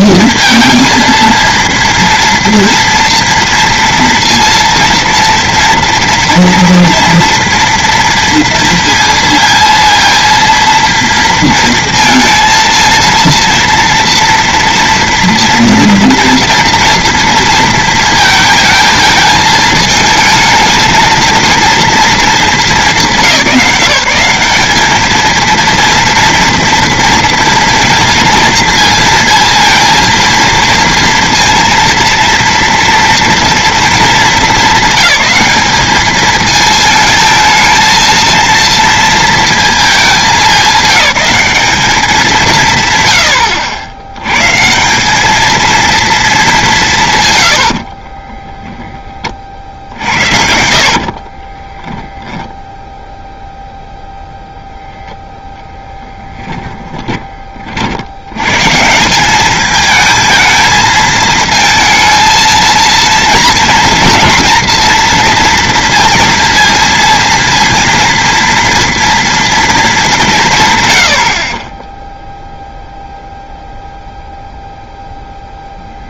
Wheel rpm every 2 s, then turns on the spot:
230, 230, 230, 230, 230, 230, 230, 240, 240, 220, 220, 210, 190, 230, 230, 230, 230, 200, 220, 230, 210, 160, 140, 210, 10, 60, 0, 0, 10, 120, 220, 230, 230, 230, 230, 150, 0, 0.
50-52